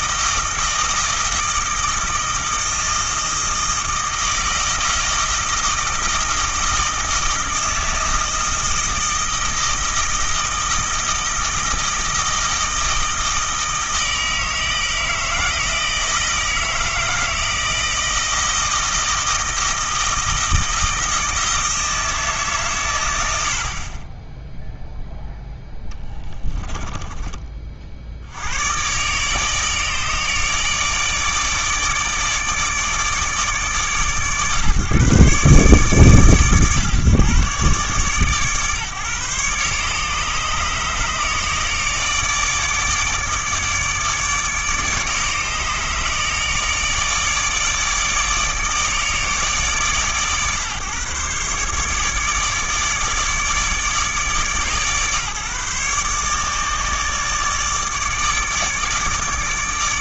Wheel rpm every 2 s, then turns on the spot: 160, 160, 160, 160, 160, 160, 160, 160, 160, 160, 160, 120, 0, 10, 130, 150, 150, 140, 120, 140, 150, 150, 150, 150, 150, 140, 150, 140, 150, 150.
26-28